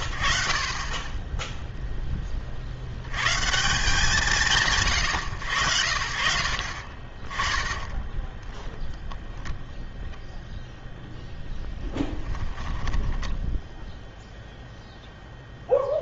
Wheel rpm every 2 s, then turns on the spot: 40, 70, 140, 50, 0, 0, 10, 0.
12-14